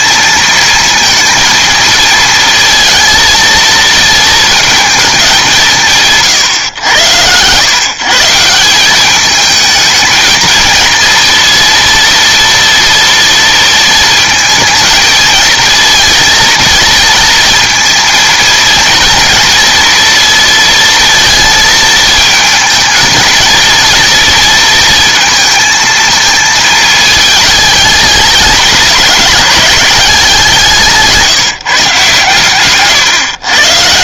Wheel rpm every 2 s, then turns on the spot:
220, 230, 230, 110, 180, 230, 230, 220, 230, 230, 230, 230, 230, 220, 200, 180, 140.
none